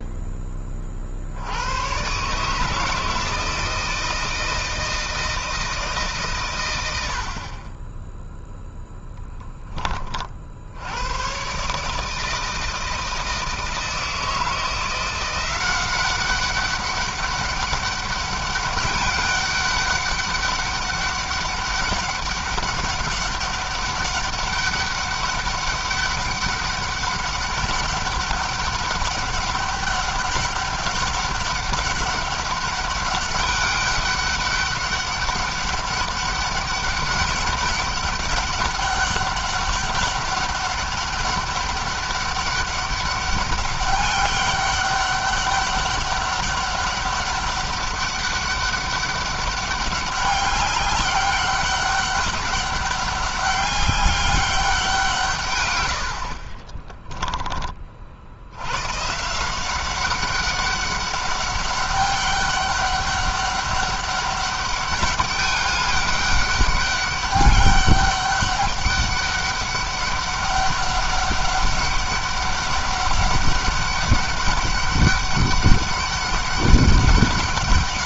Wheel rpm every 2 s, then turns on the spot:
50, 160, 160, 90, 0, 90, 160, 170, 200, 200, 200, 200, 200, 200, 200, 200, 200, 200, 200, 200, 200, 200, 200, 200, 200, 200, 200, 170, 20, 130, 200, 200, 200, 200, 200, 200, 200, 200, 200.
56-58